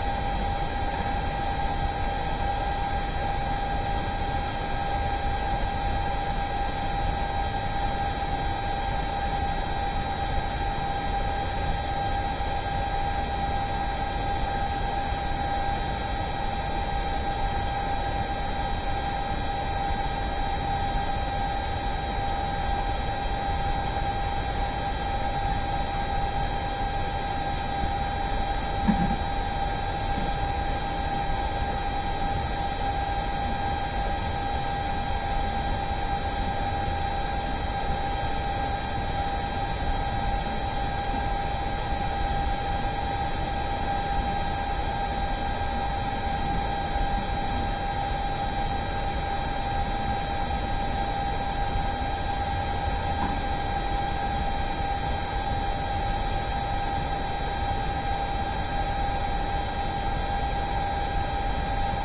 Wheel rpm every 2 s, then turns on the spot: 0, 0, 0, 0, 0, 0, 0, 0, 0, 0, 0, 0, 0, 0, 0, 0, 0, 0, 0, 0, 0, 0, 0, 0, 0, 0, 0, 0, 0, 0, 0.
none